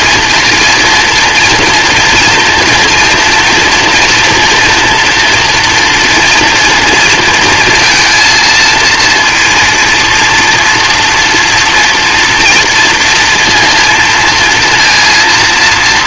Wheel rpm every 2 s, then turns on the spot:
230, 230, 230, 230, 230, 240, 230, 230.
none